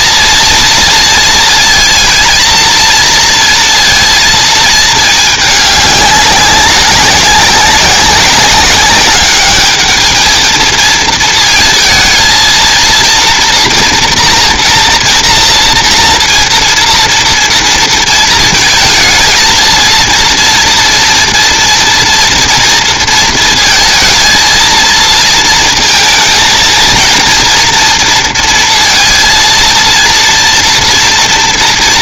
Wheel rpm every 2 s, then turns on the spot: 230, 230, 200, 190, 220, 220, 240, 230, 230, 230, 230, 230, 230, 230, 230, 230.
none